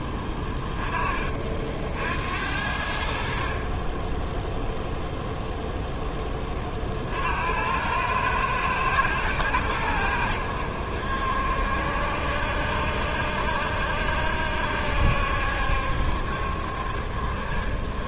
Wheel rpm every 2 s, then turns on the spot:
20, 50, 0, 50, 110, 70, 70, 70, 60.
none